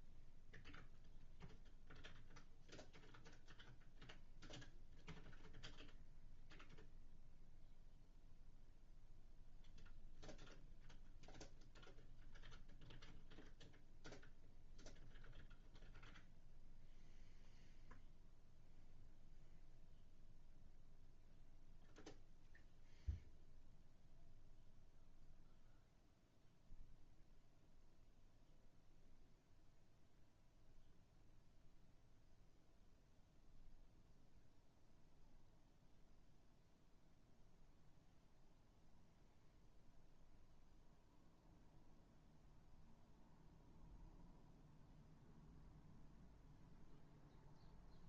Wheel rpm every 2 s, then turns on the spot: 0, 0, 0, 0, 0, 0, 0, 0, 0, 0, 0, 0, 0, 0, 0, 0, 0, 0, 0, 0, 0, 0, 0, 0.
none